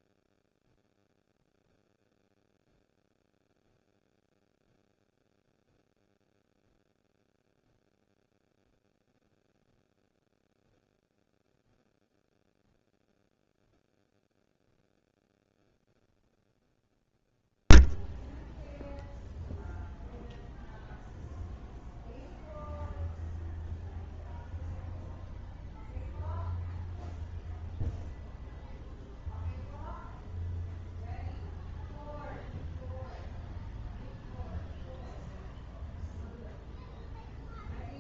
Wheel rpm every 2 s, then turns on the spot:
0, 0, 0, 0, 0, 0, 0, 0, 0, 0, 0, 0, 0, 0, 0, 0, 0, 0, 0.
none